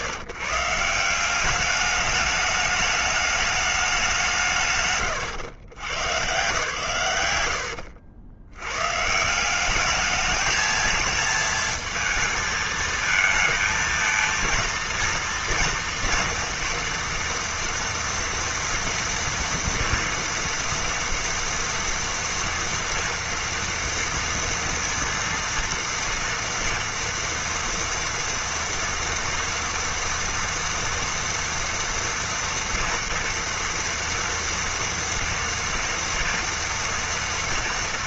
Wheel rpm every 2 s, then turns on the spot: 140, 210, 150, 140, 100, 220, 220, 230, 230, 230, 230, 230, 230, 230, 230, 230, 230, 230, 230.
none